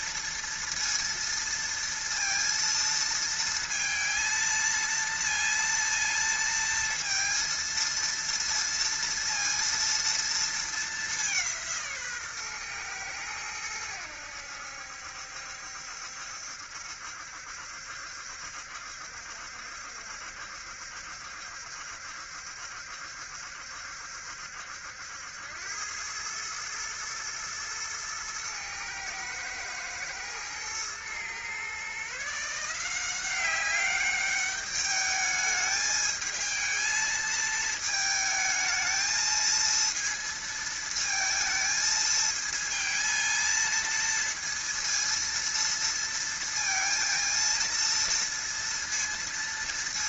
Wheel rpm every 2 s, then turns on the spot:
230, 230, 230, 230, 230, 230, 140, 80, 70, 70, 70, 70, 70, 110, 110, 110, 150, 200, 220, 220, 230, 220, 230, 230, 230.
none